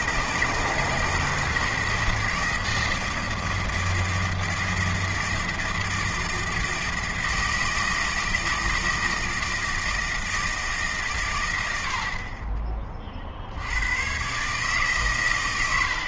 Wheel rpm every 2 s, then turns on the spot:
160, 160, 160, 160, 160, 150, 30, 140.
none